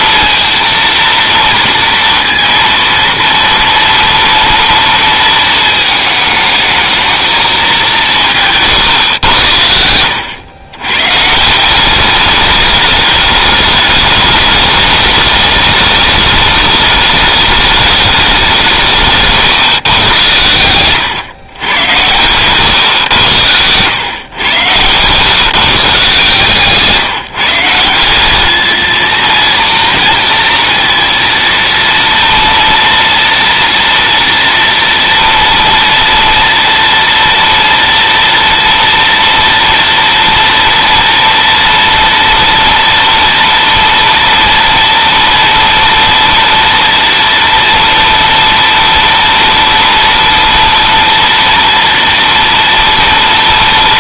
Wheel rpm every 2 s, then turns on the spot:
230, 230, 230, 220, 170, 90, 200, 210, 210, 200, 110, 120, 120, 150, 190, 230, 230, 230, 230, 230, 240, 230, 230, 230, 230, 230, 230.
none